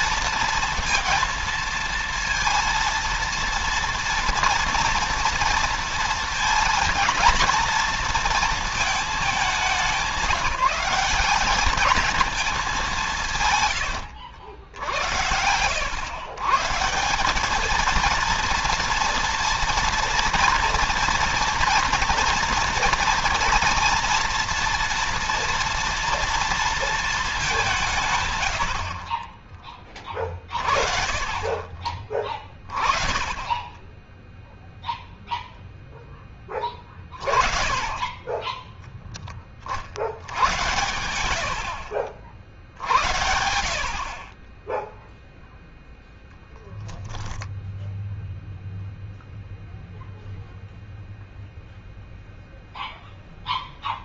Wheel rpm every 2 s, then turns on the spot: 230, 230, 240, 230, 220, 180, 200, 80, 140, 230, 230, 230, 230, 230, 60, 40, 20, 0, 30, 10, 90, 80, 10, 0, 0, 0, 0.
none